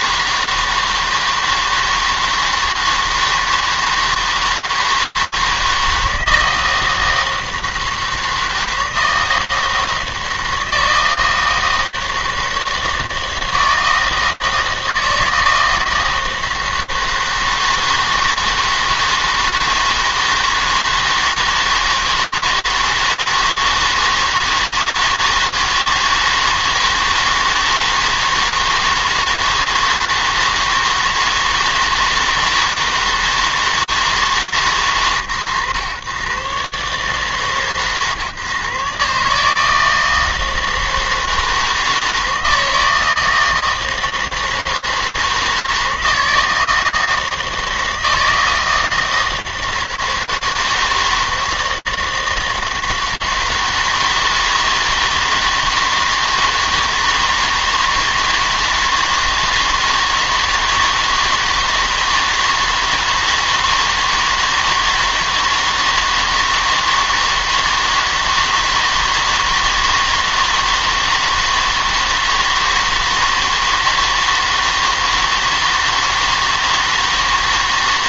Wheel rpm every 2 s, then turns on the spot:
160, 160, 160, 160, 160, 160, 160, 160, 160, 160, 160, 160, 160, 160, 160, 160, 160, 150, 130, 120, 160, 160, 160, 160, 160, 160, 160, 160, 160, 160, 160, 160, 160, 160, 160, 160, 160, 160, 160.
none